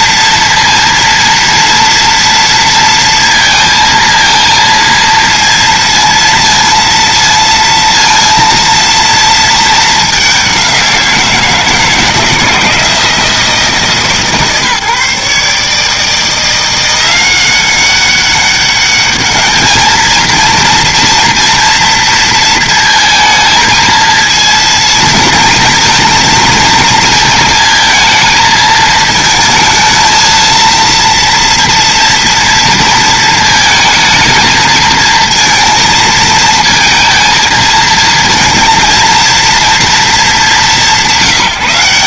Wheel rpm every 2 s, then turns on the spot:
230, 230, 230, 230, 230, 180, 170, 150, 170, 200, 230, 230, 230, 230, 220, 230, 230, 220, 230, 230, 200.
none